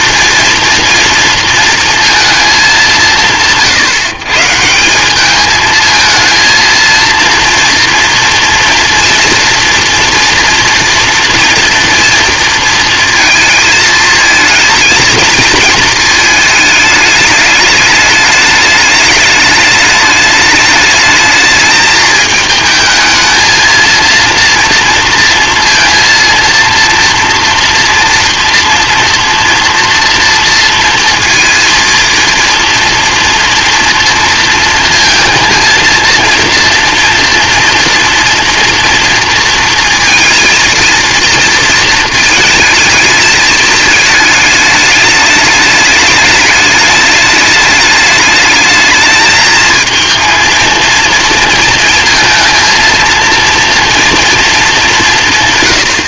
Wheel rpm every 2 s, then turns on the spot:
230, 220, 160, 220, 230, 240, 230, 220, 220, 210, 210, 220, 230, 230, 230, 230, 230, 230, 230, 230, 220, 220, 210, 210, 210, 230, 230, 220.
none